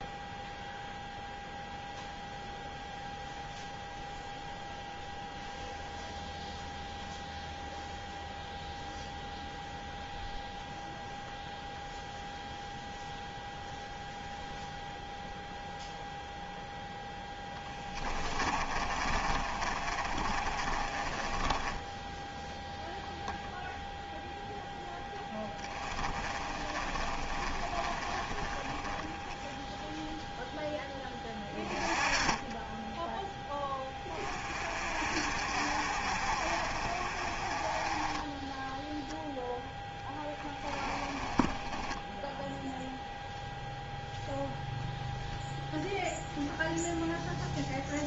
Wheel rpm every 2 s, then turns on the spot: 0, 0, 0, 0, 0, 0, 0, 0, 0, 30, 30, 0, 0, 20, 30, 0, 10, 40, 40, 10, 10, 0, 0, 0.
18-22 26-30 40-42